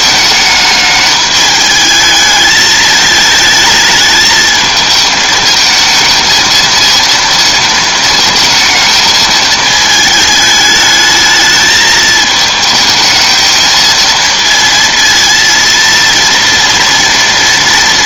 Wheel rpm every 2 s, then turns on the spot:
210, 220, 220, 230, 220, 210, 220, 230, 230.
none